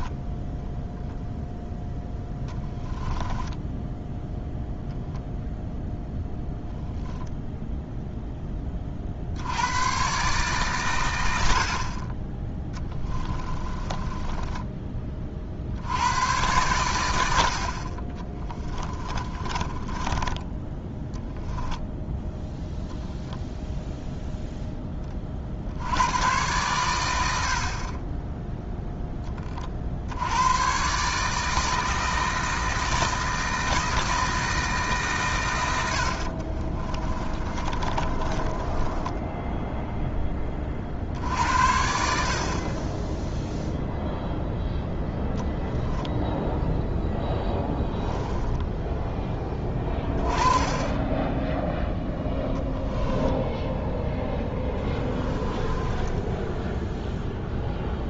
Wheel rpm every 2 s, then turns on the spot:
10, 20, 0, 0, 40, 120, 10, 20, 110, 20, 10, 0, 20, 100, 0, 130, 160, 150, 40, 20, 50, 20, 0, 0, 0, 20, 10, 20, 0.
0-4 12-14 18-22 36-40 54-56